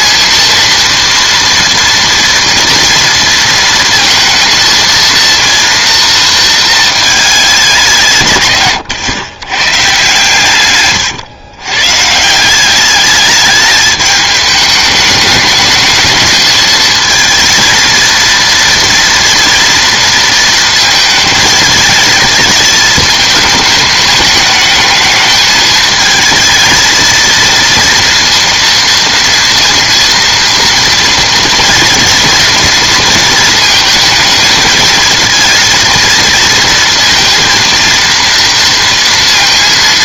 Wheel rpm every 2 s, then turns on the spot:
230, 230, 230, 220, 120, 130, 190, 210, 220, 240, 230, 220, 210, 220, 230, 230, 230, 220, 230, 230.
10-12